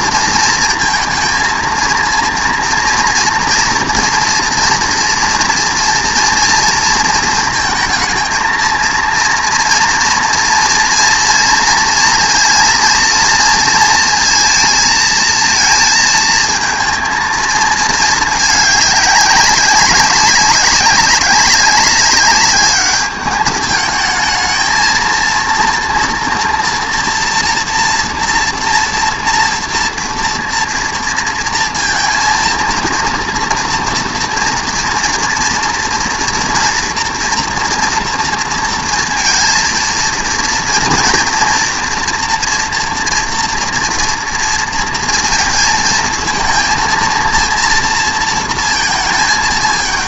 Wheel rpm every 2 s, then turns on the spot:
230, 230, 230, 230, 230, 230, 230, 230, 230, 210, 200, 210, 220, 240, 230, 230, 230, 240, 230, 230, 230, 230, 230, 230, 220.
none